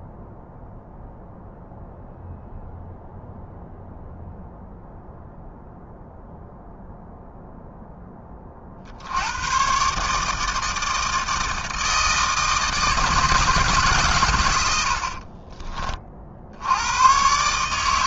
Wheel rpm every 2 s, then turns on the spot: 0, 0, 0, 0, 40, 160, 160, 100, 70.
none